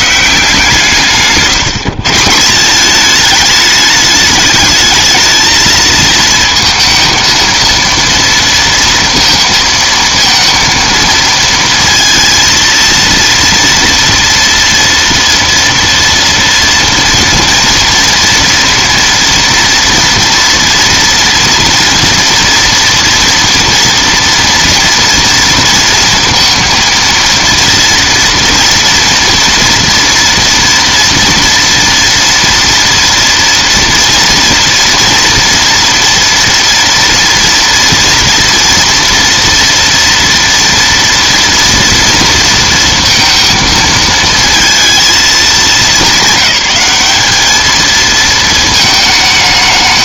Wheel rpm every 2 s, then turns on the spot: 160, 170, 220, 230, 230, 230, 230, 230, 230, 230, 230, 230, 230, 230, 230, 230, 230, 240, 230, 230, 240, 230, 230, 200, 220.
none